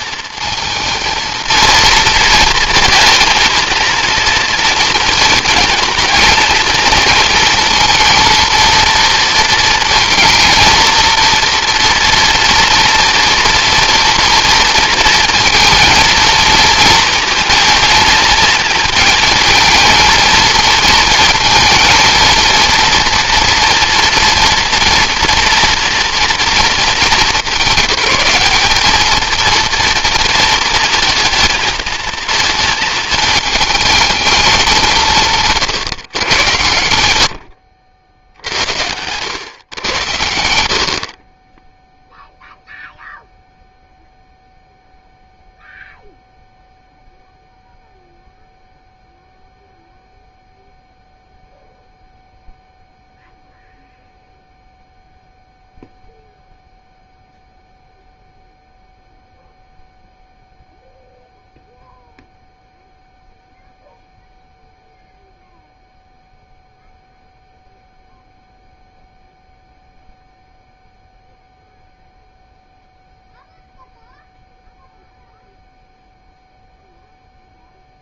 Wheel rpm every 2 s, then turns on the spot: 230, 230, 230, 230, 230, 230, 230, 230, 230, 220, 220, 230, 230, 210, 210, 230, 220, 190, 90, 90, 60, 0, 0, 0, 0, 0, 0, 0, 0, 0, 0, 0, 0, 0, 0, 0, 0, 0, 0.
none